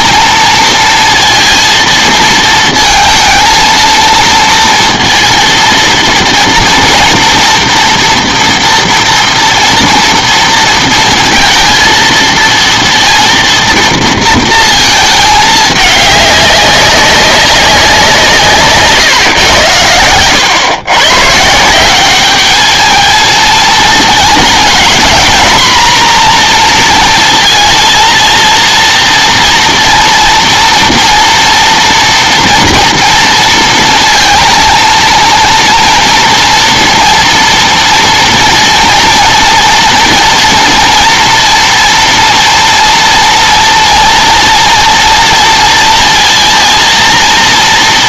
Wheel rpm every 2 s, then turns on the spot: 230, 230, 230, 230, 230, 230, 230, 220, 200, 140, 120, 210, 230, 230, 230, 230, 230, 220, 230, 230, 230, 240, 230, 230.
18-20